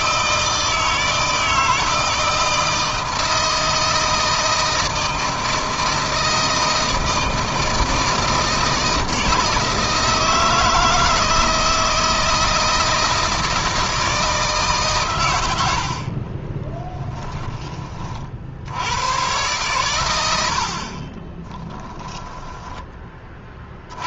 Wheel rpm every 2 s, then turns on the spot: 160, 160, 160, 160, 160, 160, 170, 150, 20, 90, 60, 20.
16-18